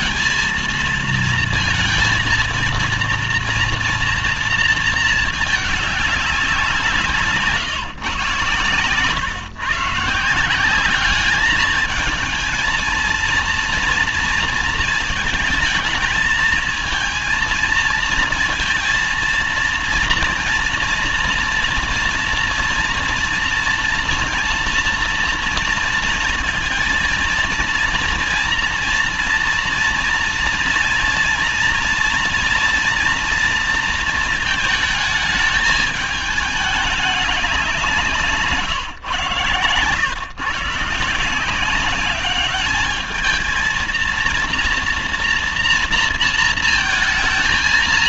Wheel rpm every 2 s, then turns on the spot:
230, 230, 230, 180, 130, 190, 220, 220, 220, 230, 230, 230, 230, 230, 230, 230, 230, 220, 210, 140, 140, 210, 230, 230.
none